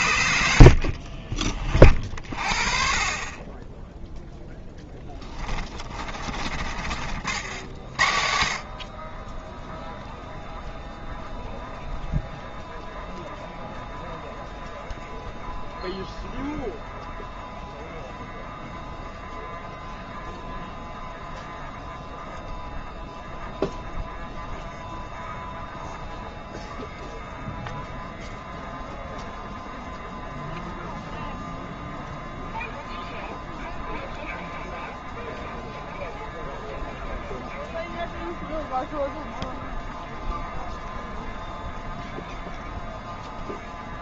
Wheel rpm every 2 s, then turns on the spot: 40, 30, 10, 60, 40, 0, 0, 0, 0, 0, 0, 0, 0, 0, 0, 0, 0, 0, 0, 0, 0, 0.
0-2 4-6 8-10